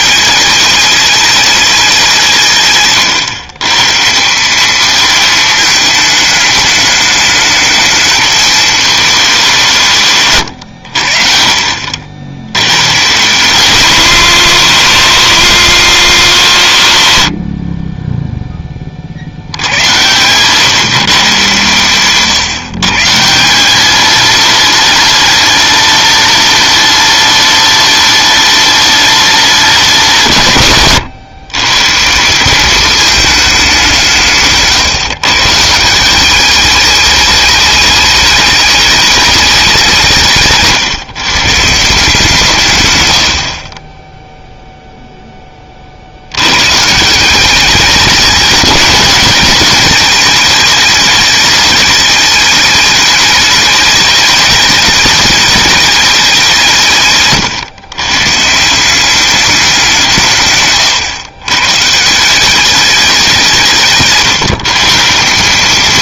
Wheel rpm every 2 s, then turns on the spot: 210, 150, 200, 210, 220, 100, 100, 200, 150, 20, 140, 130, 210, 210, 210, 140, 200, 140, 210, 210, 150, 130, 0, 120, 210, 220, 210, 210, 160, 170, 130, 190, 160.
34-36 40-42